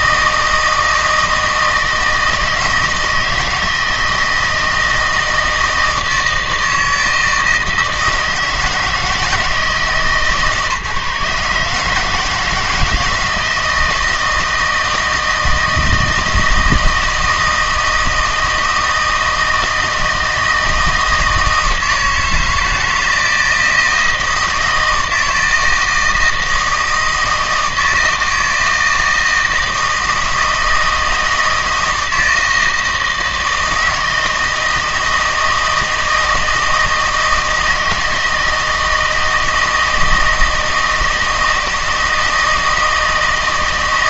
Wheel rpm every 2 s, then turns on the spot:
160, 160, 160, 160, 160, 150, 160, 160, 160, 160, 160, 160, 160, 160, 160, 160, 160, 170, 160, 160, 160, 160.
none